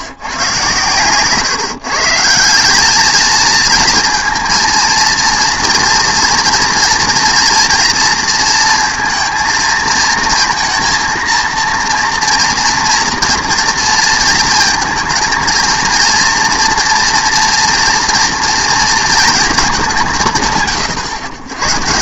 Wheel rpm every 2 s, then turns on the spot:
120, 190, 230, 230, 230, 230, 230, 220, 230, 230, 130.
none